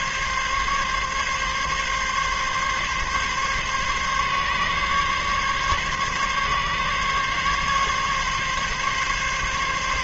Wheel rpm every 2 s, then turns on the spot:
140, 140, 140, 140, 140.
none